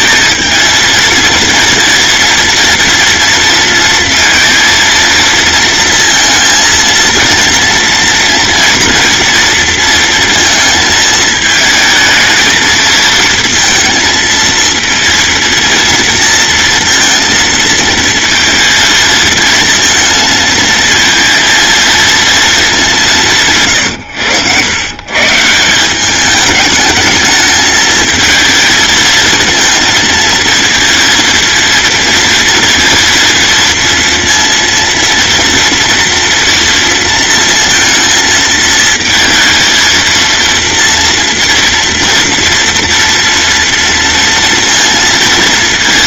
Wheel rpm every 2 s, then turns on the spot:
230, 230, 230, 230, 240, 220, 230, 230, 230, 230, 230, 200, 110, 210, 220, 230, 230, 230, 230, 220, 230, 240, 230.
none